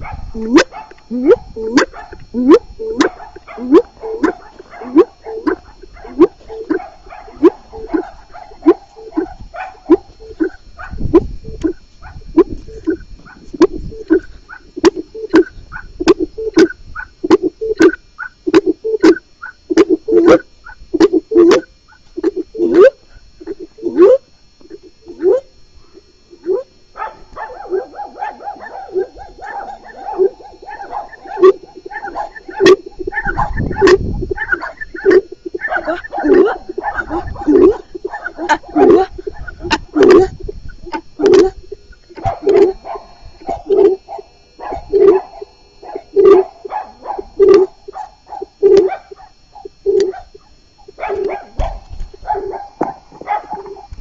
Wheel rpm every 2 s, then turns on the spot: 0, 0, 0, 0, 0, 0, 0, 0, 0, 0, 0, 0, 0, 0, 0, 0, 0, 0, 0, 0, 0, 0, 0, 0, 0, 0, 0.
none